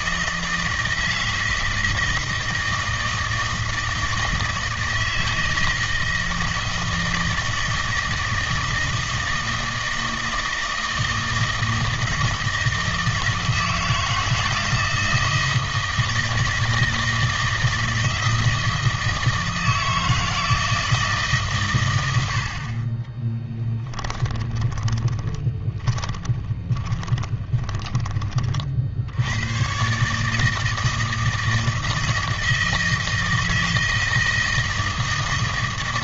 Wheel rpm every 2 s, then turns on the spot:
160, 160, 160, 160, 160, 160, 160, 160, 160, 160, 160, 50, 20, 20, 40, 160, 160, 160.
24-28